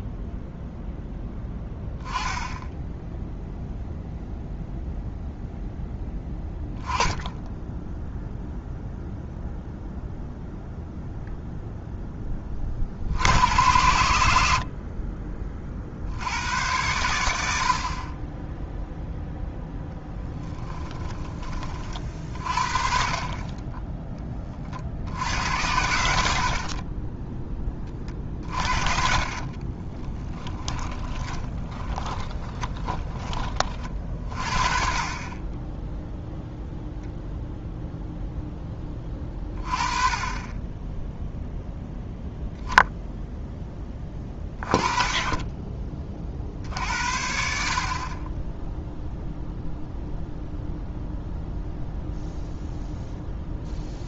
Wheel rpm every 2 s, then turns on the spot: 0, 10, 0, 10, 0, 0, 30, 60, 90, 0, 10, 40, 40, 40, 50, 20, 20, 40, 0, 10, 10, 10, 20, 60, 0, 0, 0.
20-22 26-34